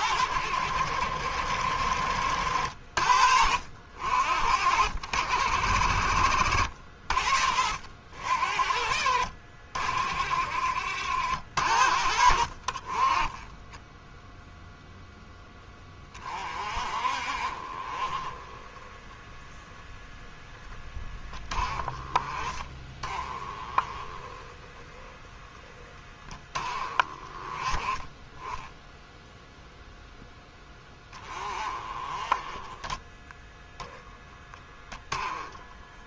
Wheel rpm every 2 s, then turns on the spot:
70, 50, 60, 60, 50, 70, 40, 0, 40, 10, 10, 20, 10, 20, 0, 10, 10, 10.
none